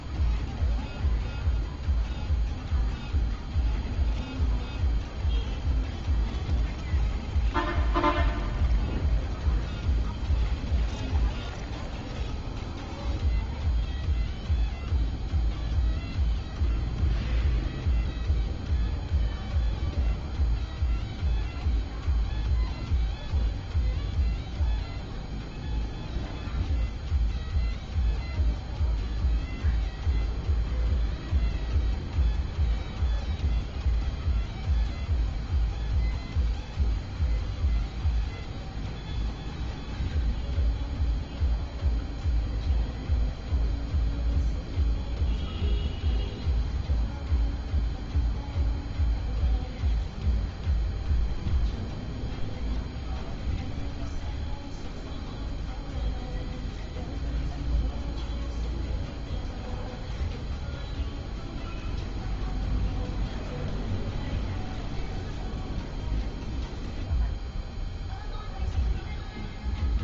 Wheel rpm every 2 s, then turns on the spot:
0, 0, 0, 0, 0, 0, 0, 0, 0, 0, 0, 0, 0, 0, 0, 0, 0, 0, 0, 0, 0, 0, 0, 0, 0, 0, 0, 0, 0, 0, 0, 0, 0, 0, 0.
none